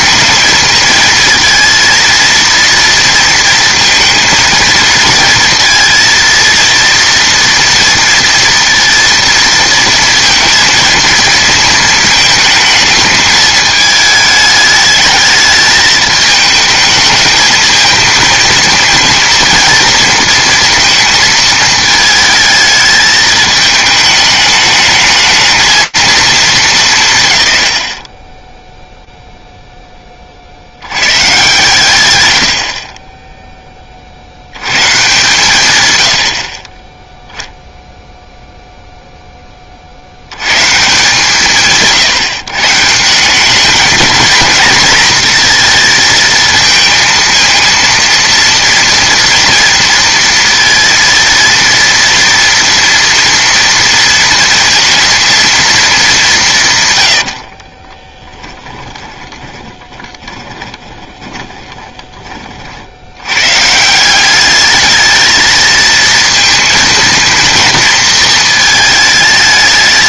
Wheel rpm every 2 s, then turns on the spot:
220, 230, 230, 230, 230, 230, 220, 220, 210, 220, 230, 220, 210, 190, 10, 100, 30, 120, 20, 0, 140, 150, 220, 230, 230, 230, 230, 230, 130, 10, 20, 70, 210, 230, 220.
58-62